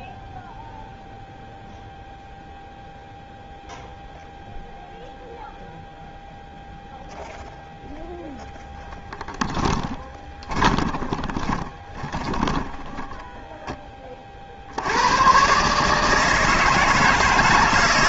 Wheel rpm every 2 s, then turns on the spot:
0, 0, 0, 0, 10, 30, 10, 140, 160.
8-12